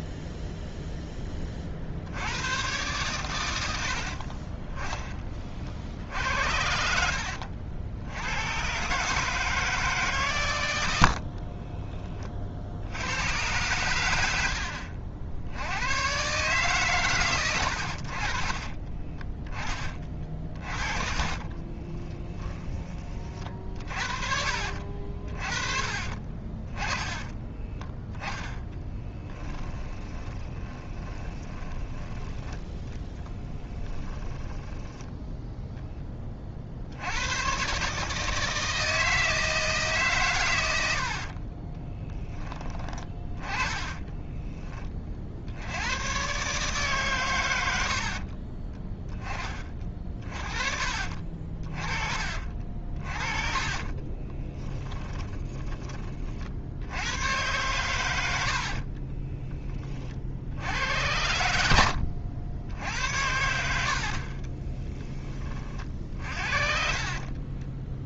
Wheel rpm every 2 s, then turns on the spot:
0, 110, 20, 70, 120, 100, 50, 70, 140, 30, 40, 20, 50, 20, 10, 20, 10, 10, 60, 160, 90, 20, 20, 140, 20, 40, 50, 10, 70, 50, 80, 70, 20, 50.
6-8 18-22 24-26 30-32 34-36 54-56 58-60 64-68